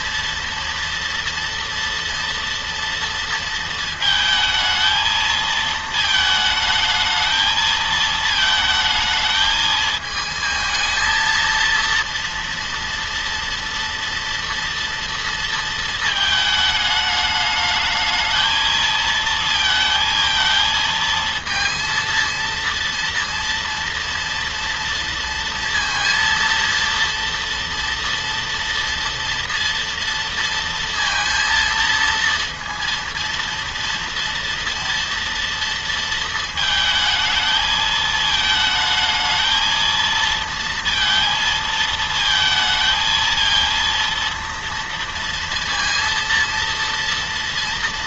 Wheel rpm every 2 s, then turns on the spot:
240, 230, 220, 220, 220, 220, 230, 230, 210, 220, 230, 230, 230, 230, 230, 230, 230, 230, 220, 220, 230, 220, 230, 230.
none